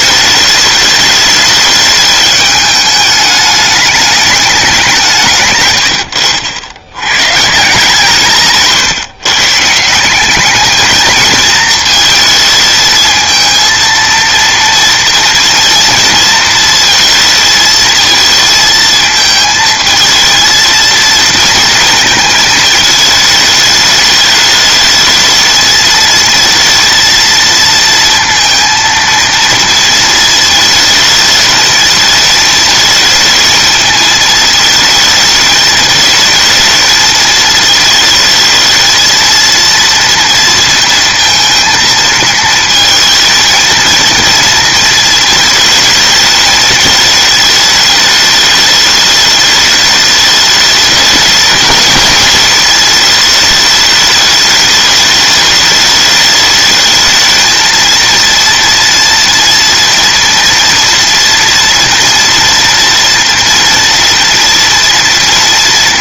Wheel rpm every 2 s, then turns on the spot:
210, 210, 210, 100, 160, 170, 220, 230, 230, 230, 220, 230, 210, 220, 230, 230, 220, 220, 220, 220, 230, 230, 230, 220, 210, 210, 210, 210, 210, 230, 230, 230, 230.
none